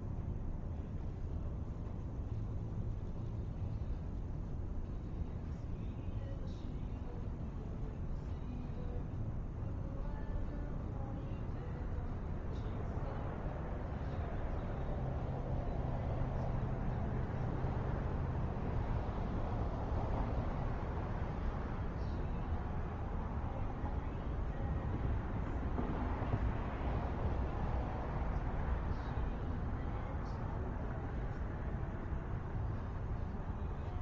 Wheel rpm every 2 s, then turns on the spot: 0, 0, 0, 0, 0, 0, 0, 0, 0, 0, 0, 0, 0, 0, 0, 0, 0.
none